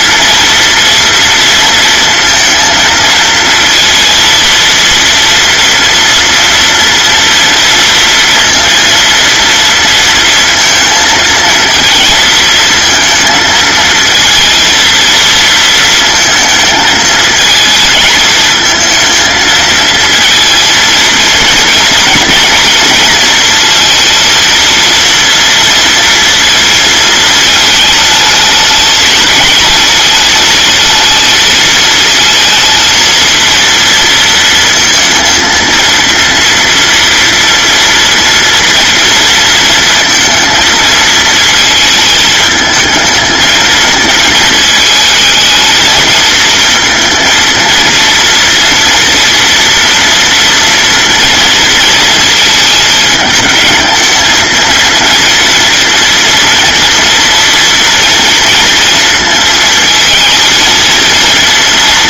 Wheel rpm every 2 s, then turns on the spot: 230, 230, 230, 230, 230, 230, 220, 230, 220, 220, 230, 230, 230, 220, 220, 230, 230, 230, 230, 230, 220, 220, 220, 230, 230, 230, 220, 230, 230, 230, 230.
none